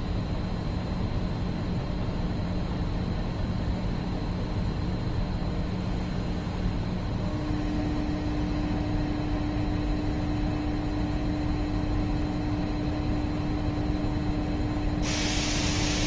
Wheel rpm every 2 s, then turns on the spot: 0, 0, 0, 0, 0, 0, 0, 0.
none